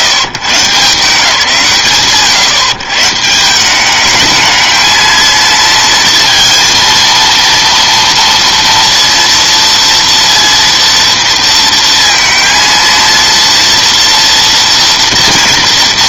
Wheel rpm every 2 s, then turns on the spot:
110, 130, 220, 230, 230, 230, 230, 230.
none